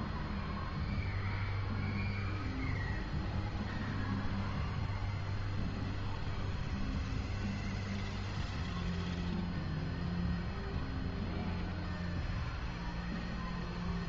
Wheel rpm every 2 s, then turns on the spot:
0, 0, 0, 0, 0, 0, 0.
none